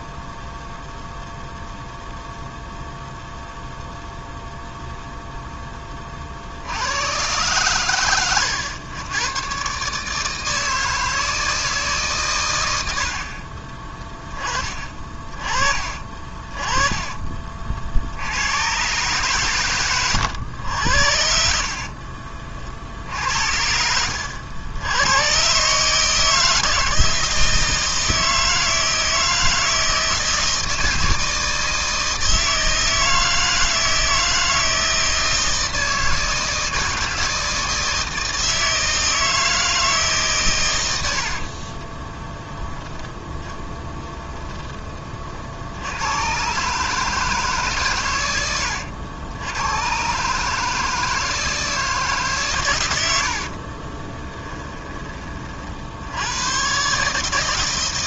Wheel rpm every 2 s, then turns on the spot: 0, 0, 0, 70, 110, 160, 100, 30, 30, 110, 90, 50, 100, 160, 160, 160, 160, 160, 160, 160, 110, 10, 20, 130, 90, 160, 120, 10, 120.
54-56